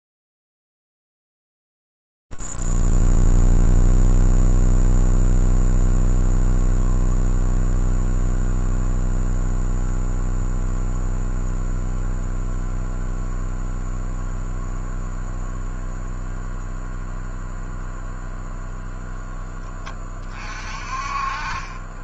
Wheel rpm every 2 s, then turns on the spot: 0, 0, 0, 0, 0, 0, 0, 0, 0, 0, 30.
none